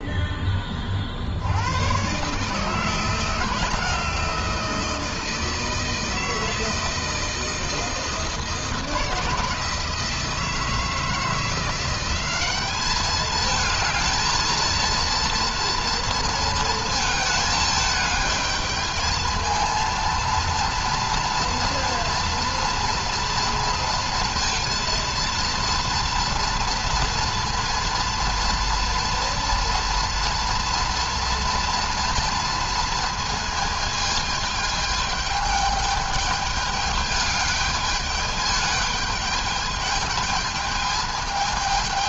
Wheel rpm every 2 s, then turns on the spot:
20, 140, 160, 160, 160, 160, 190, 230, 230, 210, 230, 230, 230, 230, 240, 230, 230, 210, 210, 210, 210.
none